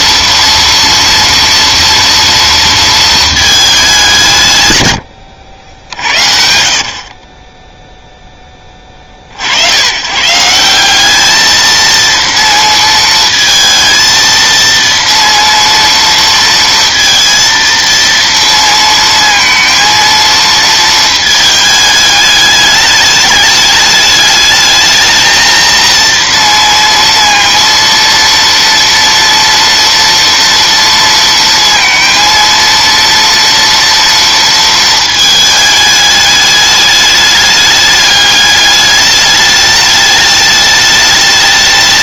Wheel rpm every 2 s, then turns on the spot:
230, 230, 160, 60, 20, 180, 230, 230, 230, 230, 230, 210, 220, 230, 230, 230, 230, 230, 210, 210, 210.
none